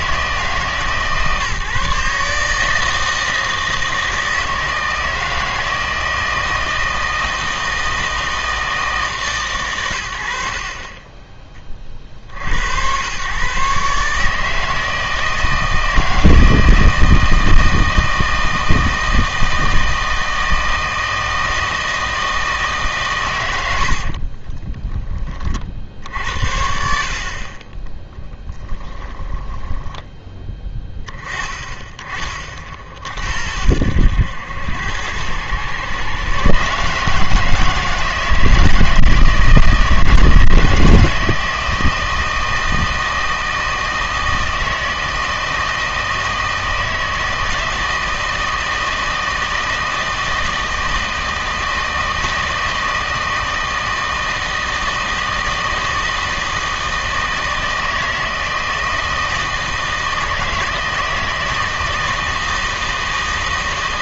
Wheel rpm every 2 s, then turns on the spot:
150, 160, 160, 160, 160, 40, 90, 160, 160, 160, 160, 150, 20, 60, 10, 20, 40, 90, 140, 160, 160, 160, 160, 160, 160, 160, 160, 160, 160, 160, 160, 160.
24-26 28-30